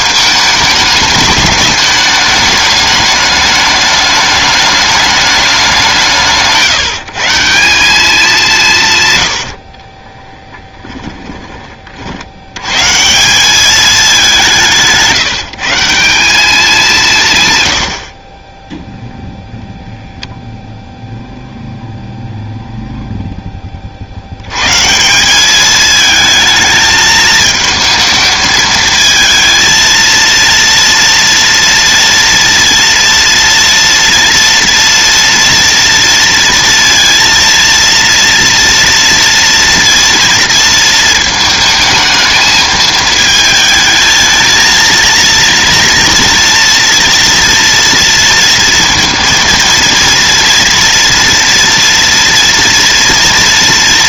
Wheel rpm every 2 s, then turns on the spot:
210, 210, 210, 160, 180, 10, 100, 180, 190, 20, 0, 0, 110, 220, 220, 230, 230, 230, 230, 230, 230, 220, 220, 230, 230, 230, 230.
10-12